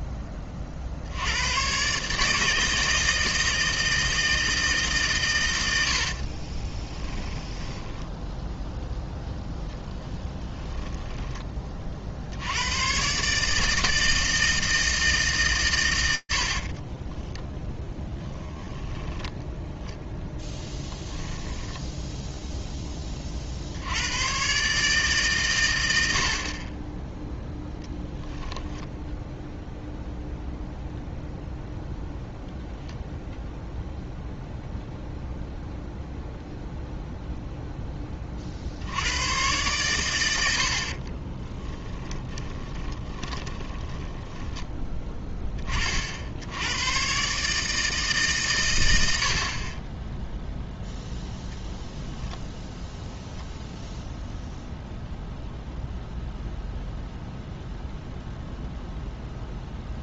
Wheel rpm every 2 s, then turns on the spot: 30, 160, 160, 30, 0, 30, 90, 160, 20, 10, 10, 30, 150, 20, 0, 0, 0, 0, 0, 90, 50, 20, 10, 110, 90, 0, 0, 0, 0, 0.
6-8 10-12 16-18 20-22 40-44